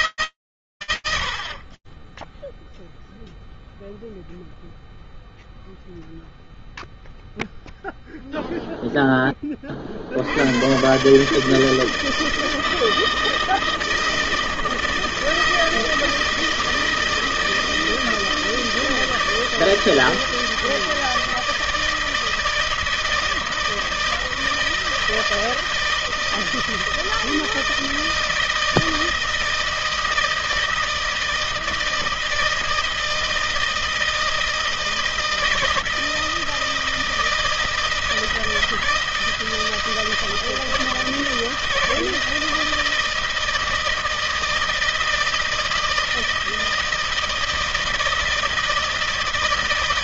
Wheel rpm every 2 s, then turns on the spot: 80, 0, 0, 0, 50, 150, 160, 160, 160, 160, 160, 160, 160, 160, 160, 160, 160, 160, 160, 160, 160, 160, 160, 160, 160.
none